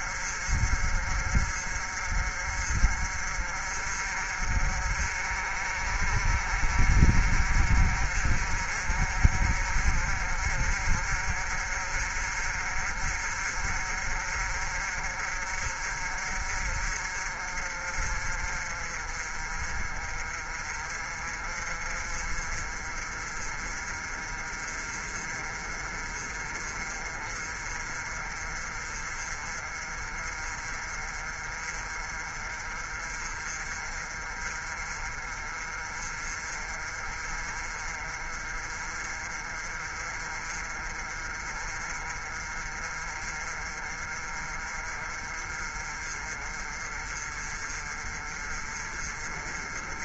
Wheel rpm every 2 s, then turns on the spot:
50, 50, 50, 50, 50, 50, 50, 50, 50, 40, 40, 40, 40, 40, 40, 40, 40, 40, 40, 40, 40, 40, 40, 40, 40.
none